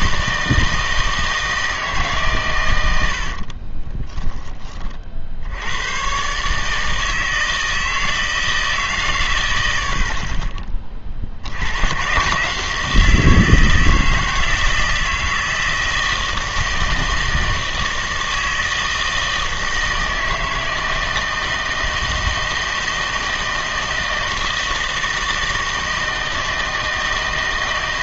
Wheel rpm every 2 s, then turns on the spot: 160, 100, 20, 150, 150, 30, 160, 160, 160, 160, 160, 160, 160, 160.
none